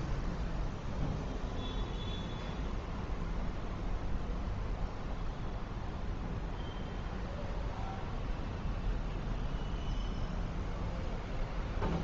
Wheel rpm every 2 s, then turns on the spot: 0, 0, 0, 0, 0, 0.
none